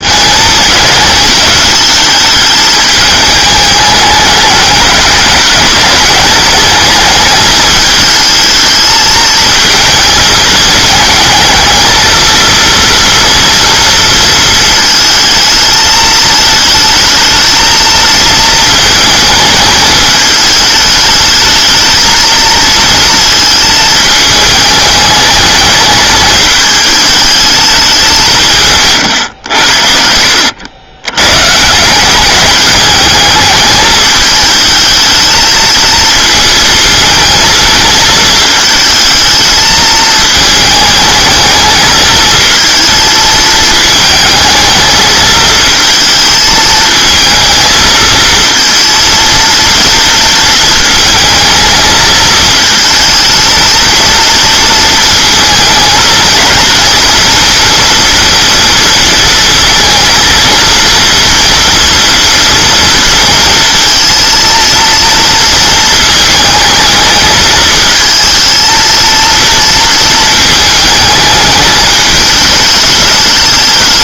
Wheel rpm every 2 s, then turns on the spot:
220, 210, 200, 210, 220, 220, 230, 220, 220, 220, 210, 220, 210, 210, 140, 90, 200, 220, 220, 220, 220, 220, 220, 220, 230, 230, 220, 230, 230, 230, 230, 230, 230, 220, 230, 220, 210.
none